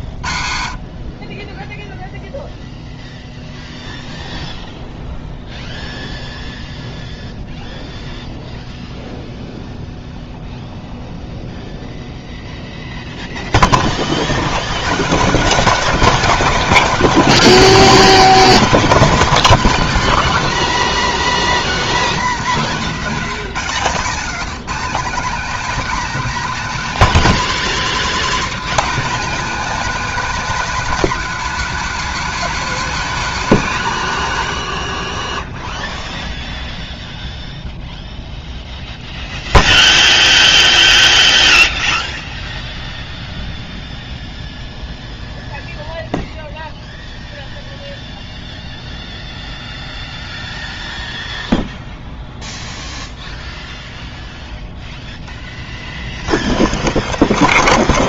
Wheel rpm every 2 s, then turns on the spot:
70, 0, 0, 0, 0, 0, 0, 100, 270, 250, 260, 240, 210, 250, 200, 270, 260, 90, 0, 0, 0, 0, 0, 0, 0, 0, 0, 10, 10.
none